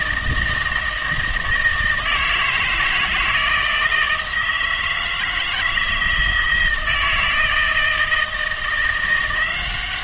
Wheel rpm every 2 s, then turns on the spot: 160, 160, 160, 160, 170.
none